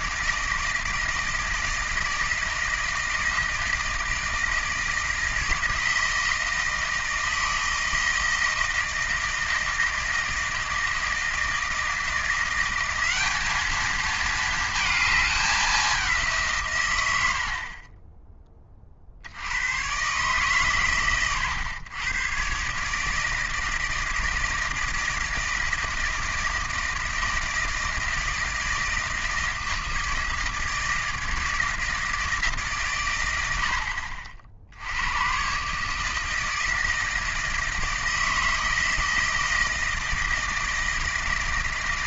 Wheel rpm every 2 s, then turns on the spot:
160, 160, 160, 160, 160, 160, 180, 220, 130, 30, 130, 130, 160, 160, 160, 160, 140, 70, 160, 160, 160.
none